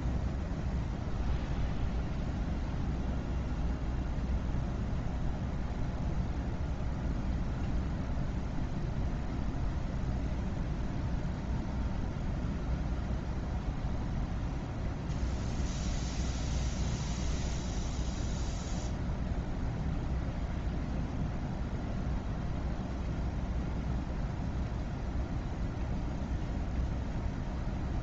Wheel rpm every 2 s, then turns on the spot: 0, 0, 0, 0, 0, 0, 0, 0, 0, 0, 0, 0, 0, 0.
none